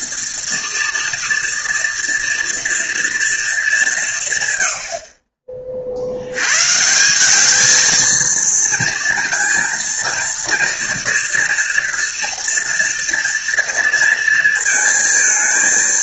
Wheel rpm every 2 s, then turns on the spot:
230, 230, 80, 160, 230, 230, 230, 230.
none